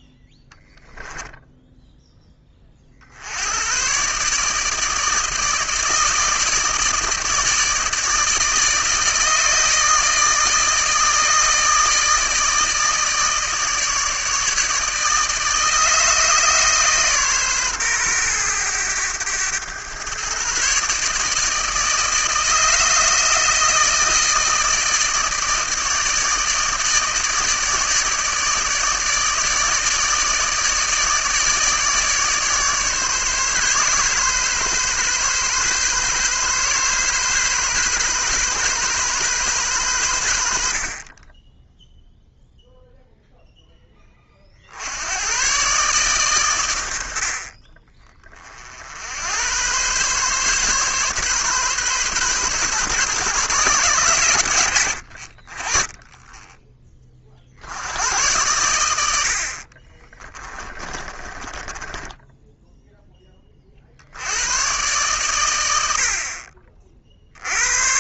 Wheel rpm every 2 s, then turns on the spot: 10, 40, 150, 160, 160, 160, 160, 150, 150, 110, 140, 160, 160, 160, 150, 150, 140, 130, 130, 130, 70, 0, 70, 100, 50, 140, 130, 50, 20, 90, 20, 10, 120, 50.
60-62